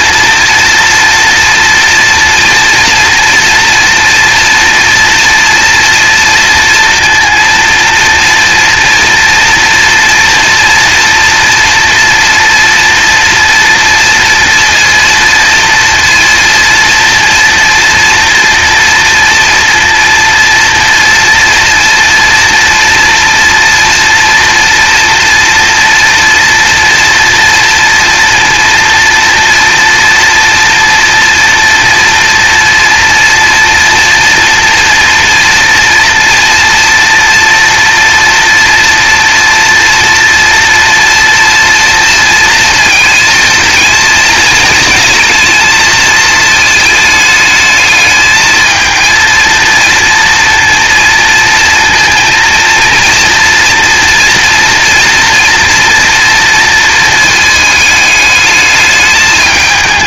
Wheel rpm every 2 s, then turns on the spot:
230, 230, 230, 240, 230, 240, 230, 230, 230, 230, 230, 230, 230, 230, 230, 230, 230, 230, 230, 240, 230, 230, 220, 220, 220, 230, 230, 240, 230, 210.
none